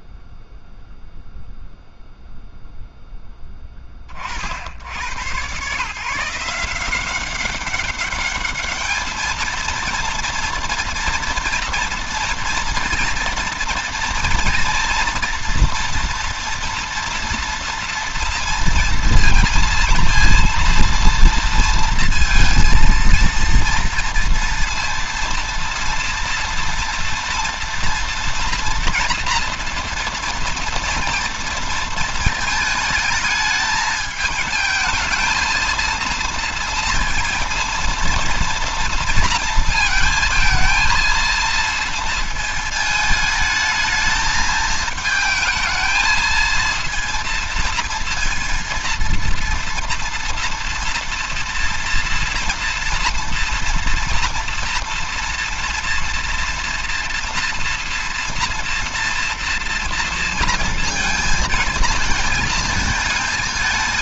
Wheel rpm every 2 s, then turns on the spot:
0, 10, 100, 180, 220, 230, 230, 230, 230, 230, 230, 230, 230, 230, 230, 230, 220, 220, 230, 230, 230, 220, 220, 230, 230, 230, 230, 230, 230, 230, 230, 220.
none